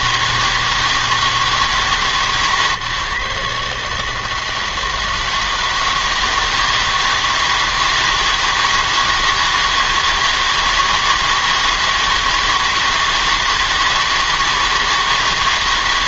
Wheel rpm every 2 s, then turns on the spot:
160, 150, 160, 160, 160, 160, 160, 160.
none